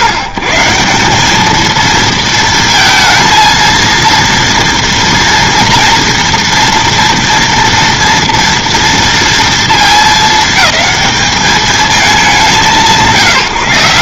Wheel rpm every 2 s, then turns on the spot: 130, 230, 230, 240, 230, 220, 180.
none